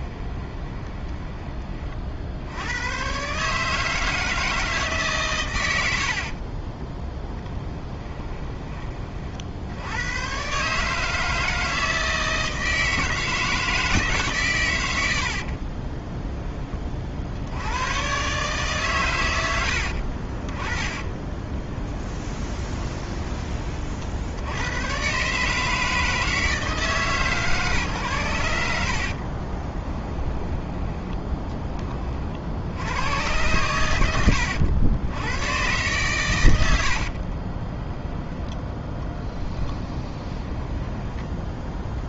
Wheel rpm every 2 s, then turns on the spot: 20, 80, 160, 20, 20, 140, 160, 130, 10, 140, 20, 20, 100, 160, 90, 10, 80, 90, 80, 10, 10.
0-2 6-8 20-24 30-32 36-42